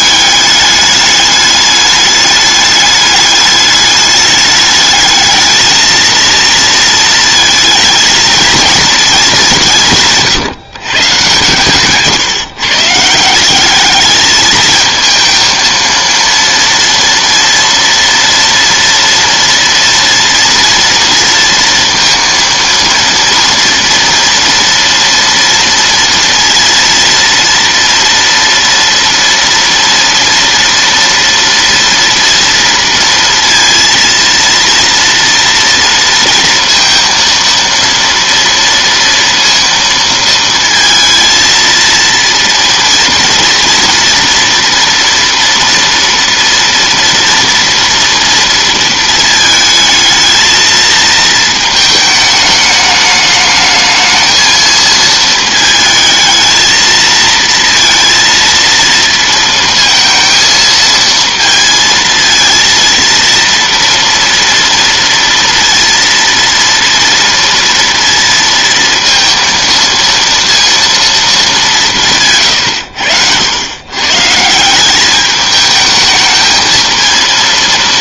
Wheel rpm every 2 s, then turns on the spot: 210, 210, 210, 230, 220, 140, 140, 220, 230, 230, 230, 230, 230, 230, 230, 230, 230, 230, 230, 230, 230, 230, 230, 230, 230, 230, 210, 220, 220, 230, 230, 230, 230, 230, 230, 230, 110, 190, 220.
none